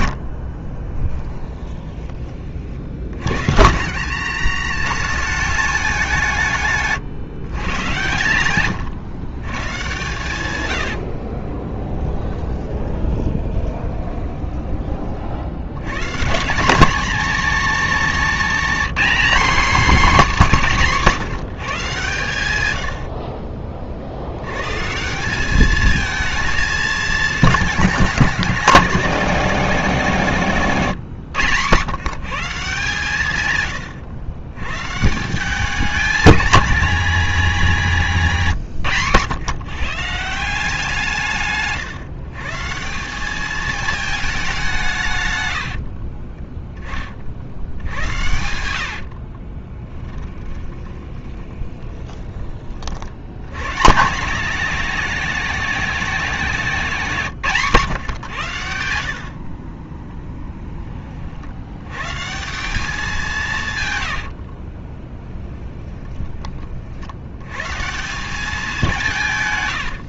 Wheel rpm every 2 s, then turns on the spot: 20, 60, 180, 140, 120, 90, 20, 30, 220, 250, 190, 90, 140, 220, 200, 140, 160, 120, 230, 140, 170, 170, 170, 20, 70, 20, 50, 210, 180, 80, 20, 190, 30, 60, 180.
0-2 12-14 30-32 48-52 64-66